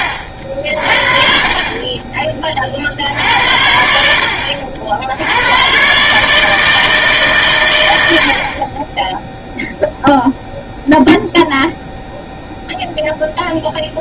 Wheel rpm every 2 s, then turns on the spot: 60, 50, 70, 150, 20, 0, 0.
none